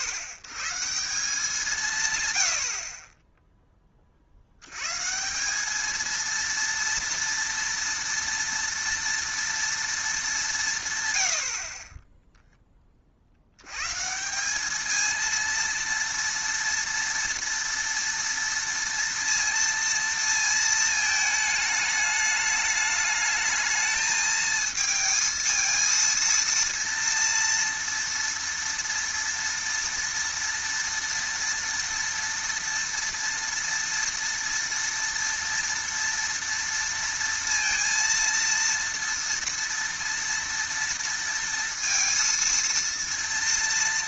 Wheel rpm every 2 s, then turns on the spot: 130, 80, 100, 230, 230, 170, 10, 200, 230, 230, 220, 210, 220, 230, 230, 230, 230, 230, 230, 230, 230, 230.
none